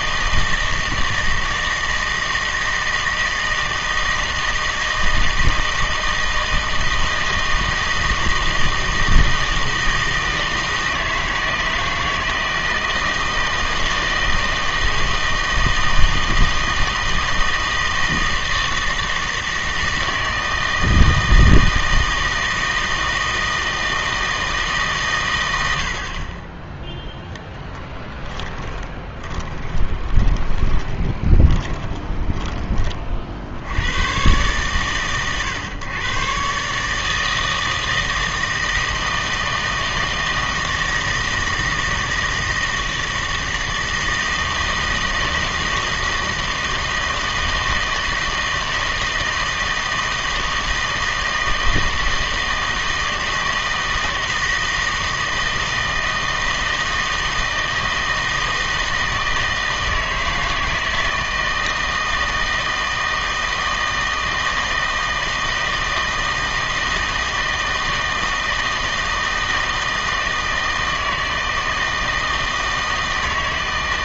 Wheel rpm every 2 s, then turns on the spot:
160, 160, 160, 160, 160, 160, 160, 160, 160, 160, 160, 160, 150, 20, 20, 20, 20, 130, 140, 160, 160, 160, 160, 160, 160, 160, 160, 160, 160, 160, 160, 160, 160, 160, 160, 160, 160.
28-32